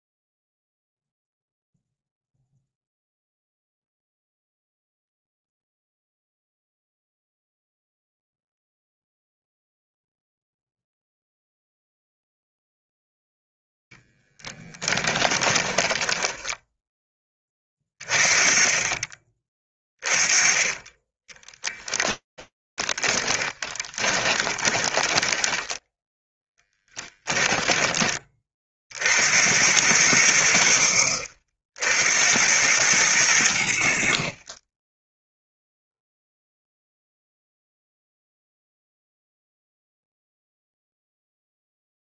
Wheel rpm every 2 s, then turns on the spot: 0, 0, 0, 0, 0, 0, 0, 20, 10, 30, 20, 20, 10, 10, 80, 60, 90, 0, 0, 0, 0.
14-16 22-28